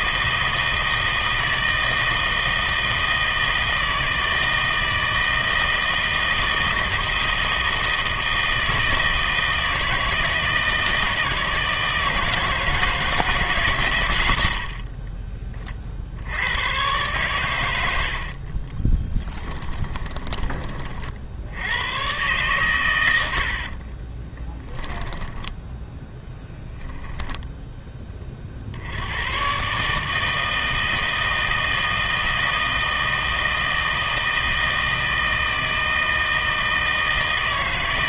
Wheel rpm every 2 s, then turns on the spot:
160, 160, 160, 160, 160, 160, 160, 50, 110, 30, 30, 110, 10, 0, 60, 160, 160, 160, 160.
14-16 18-20 24-26